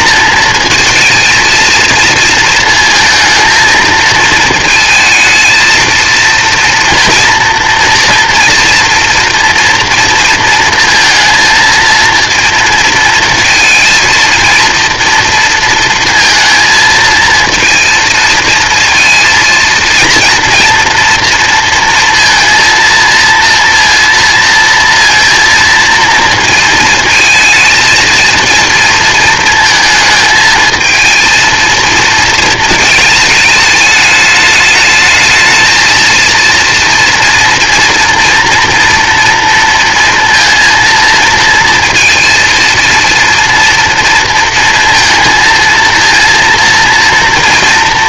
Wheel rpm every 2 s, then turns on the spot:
230, 220, 220, 230, 230, 230, 230, 230, 230, 230, 230, 230, 230, 230, 230, 220, 220, 210, 230, 230, 230, 230, 230, 230.
none